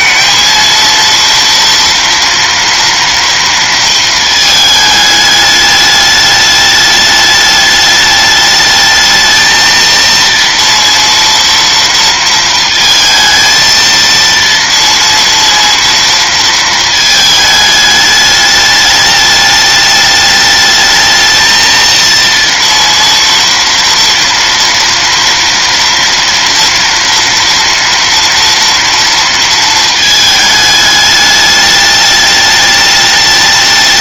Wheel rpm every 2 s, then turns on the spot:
230, 230, 220, 210, 210, 230, 230, 230, 230, 210, 210, 230, 230, 230, 240, 220, 210.
none